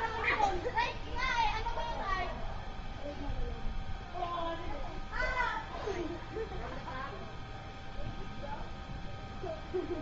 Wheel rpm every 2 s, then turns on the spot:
0, 0, 0, 0, 0.
none